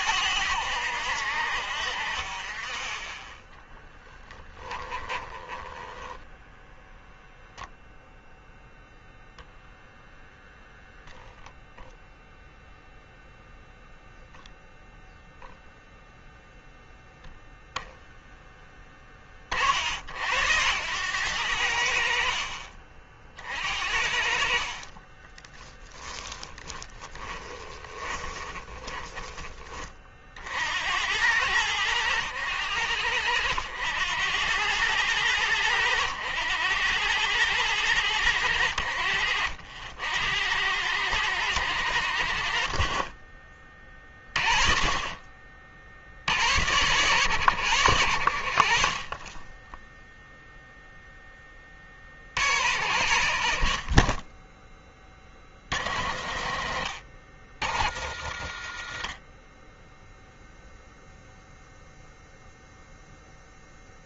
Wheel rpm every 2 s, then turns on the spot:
80, 30, 10, 0, 0, 20, 0, 0, 0, 10, 80, 40, 30, 10, 20, 80, 90, 100, 100, 80, 90, 30, 30, 100, 50, 0, 60, 20, 70, 50, 0, 0.
4-6 10-12 24-30 42-44